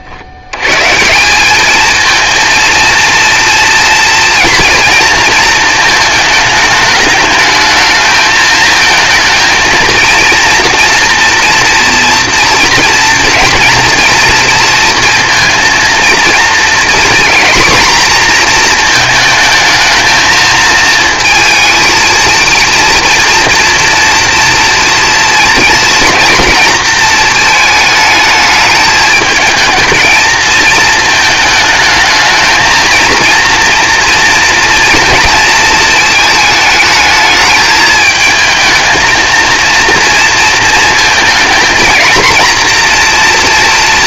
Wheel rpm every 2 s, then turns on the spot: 140, 230, 230, 210, 220, 230, 230, 230, 240, 230, 230, 230, 230, 220, 210, 220, 230, 230, 220, 220, 230, 240.
none